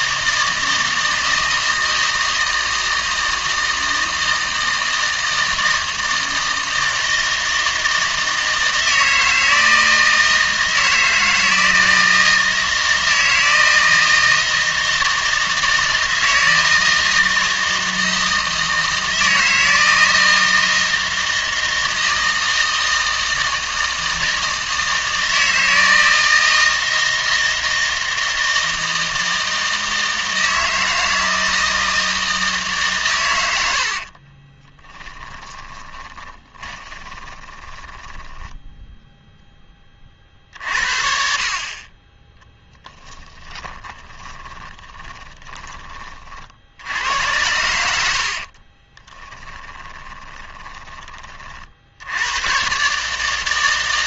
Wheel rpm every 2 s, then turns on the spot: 160, 160, 160, 160, 160, 160, 160, 160, 160, 160, 160, 160, 160, 160, 160, 160, 150, 20, 20, 10, 60, 10, 20, 70, 40, 10, 130.
34-40 44-46 48-50